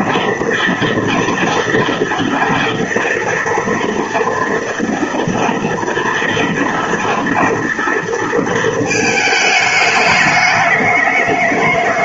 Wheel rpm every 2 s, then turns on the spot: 230, 230, 240, 240, 230, 210.
none